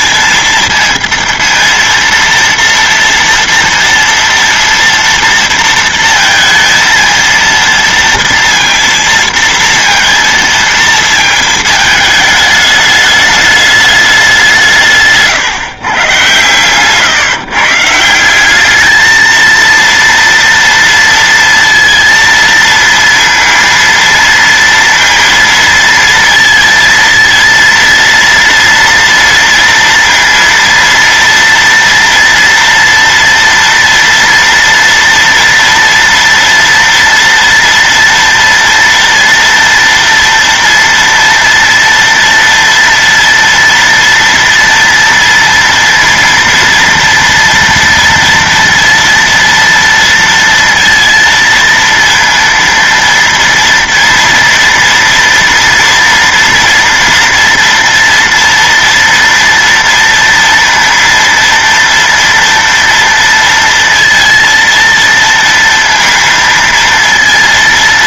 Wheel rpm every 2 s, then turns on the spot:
230, 230, 230, 230, 230, 230, 210, 170, 120, 210, 230, 230, 230, 230, 230, 230, 230, 230, 230, 230, 240, 230, 230, 230, 230, 230, 230, 230, 230, 230, 230, 230, 230, 230.
none